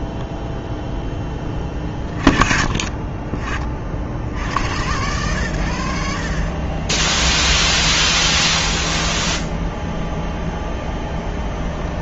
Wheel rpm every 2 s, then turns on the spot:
10, 40, 70, 50, 0, 0.
none